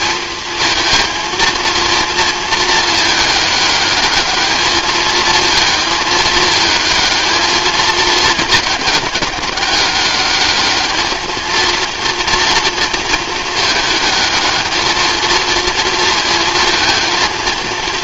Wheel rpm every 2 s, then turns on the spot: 230, 220, 210, 220, 220, 210, 230, 220, 220.
none